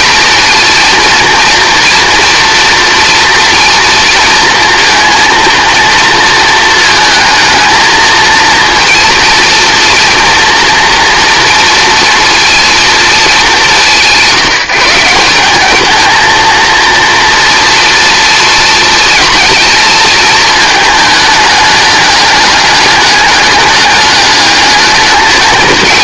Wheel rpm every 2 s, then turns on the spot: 230, 230, 230, 220, 230, 230, 230, 170, 230, 230, 220, 210, 210.
none